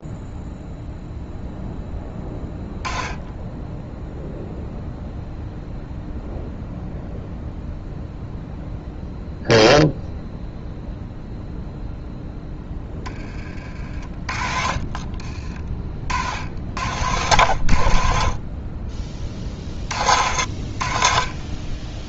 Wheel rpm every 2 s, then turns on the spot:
0, 10, 0, 0, 0, 0, 10, 40, 80, 30, 50.
none